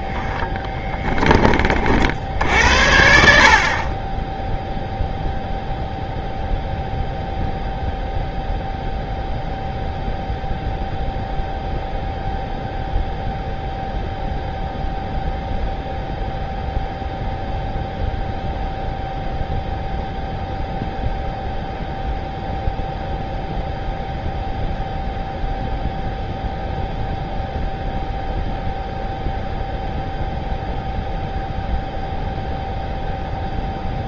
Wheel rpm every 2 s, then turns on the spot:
0, 50, 40, 0, 0, 0, 0, 0, 0, 0, 0, 0, 0, 0, 0, 0, 0.
none